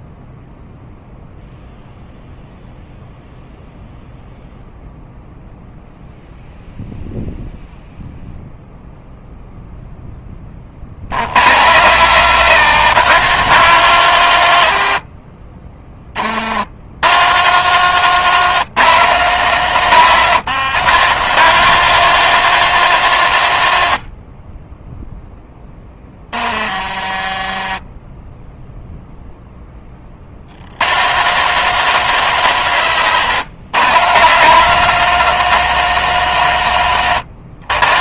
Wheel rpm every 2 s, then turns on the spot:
0, 0, 0, 0, 0, 100, 170, 60, 120, 170, 170, 150, 10, 30, 0, 150, 140, 180, 120.
none